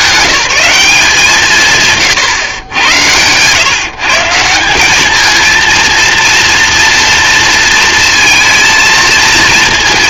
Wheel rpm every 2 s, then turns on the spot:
180, 100, 190, 230, 230.
none